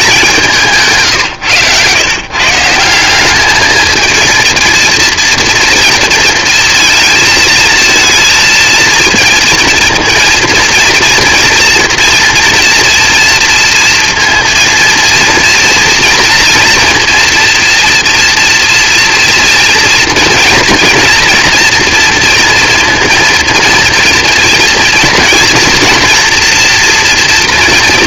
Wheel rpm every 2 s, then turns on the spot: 170, 150, 230, 230, 230, 230, 230, 230, 230, 230, 230, 230, 230, 230.
none